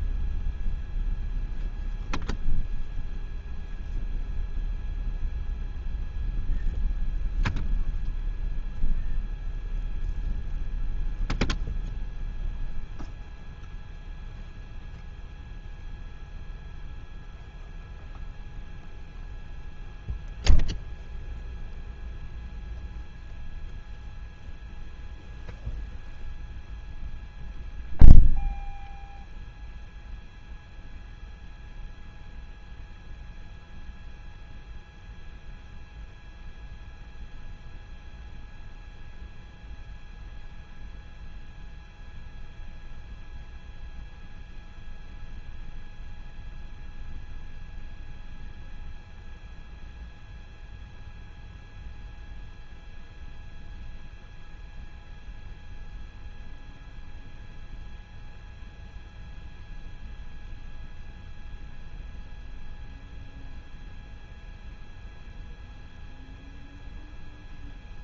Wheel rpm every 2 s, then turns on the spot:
0, 0, 0, 0, 0, 0, 0, 0, 0, 0, 0, 0, 0, 0, 0, 0, 0, 0, 0, 0, 0, 0, 0, 0, 0, 0, 0, 0, 0, 0, 0, 0, 0, 0.
none